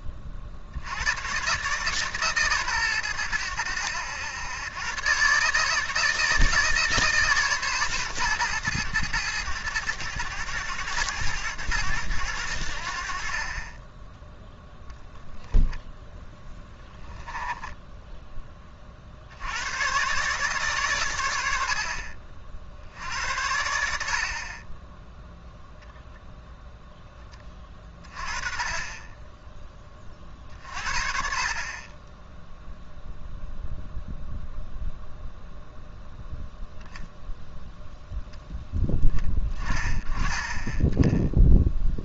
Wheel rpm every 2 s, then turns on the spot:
60, 130, 110, 150, 110, 110, 80, 0, 10, 30, 130, 50, 30, 0, 30, 40, 0, 0, 0, 10, 10.
16-18